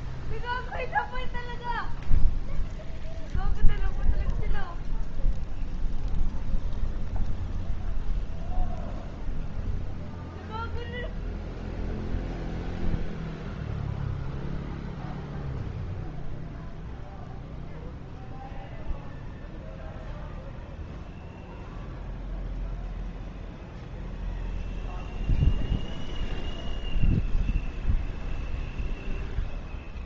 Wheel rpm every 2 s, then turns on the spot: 0, 0, 0, 0, 0, 0, 0, 0, 0, 0, 0, 0, 0, 0, 0.
none